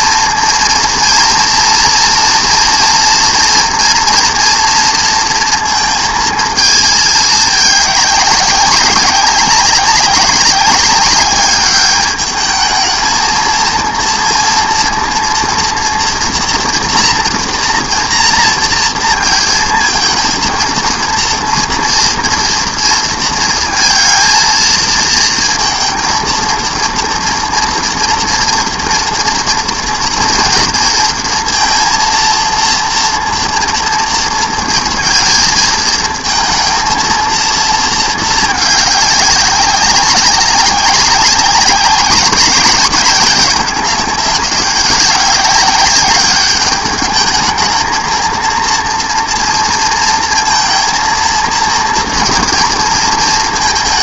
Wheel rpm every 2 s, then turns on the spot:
230, 230, 230, 220, 200, 200, 220, 230, 230, 230, 230, 230, 230, 230, 230, 230, 230, 230, 230, 210, 200, 200, 190, 210, 230, 230, 230.
none